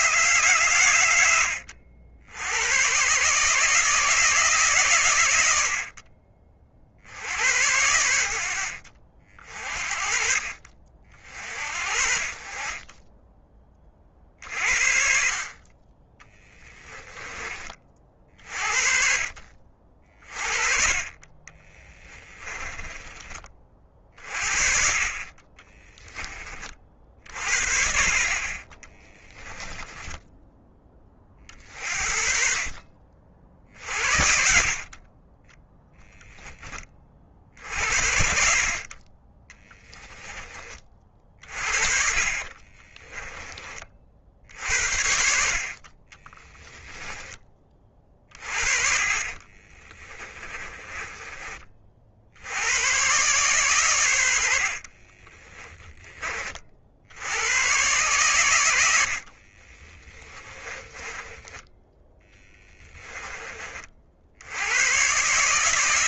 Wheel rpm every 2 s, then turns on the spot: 120, 110, 140, 50, 60, 50, 30, 50, 10, 40, 30, 20, 40, 40, 20, 20, 50, 50, 20, 30, 30, 30, 70, 10, 40, 20, 100, 40, 50, 90, 20, 10, 110.
16-18 22-24 28-30 42-44 46-52 54-56 60-64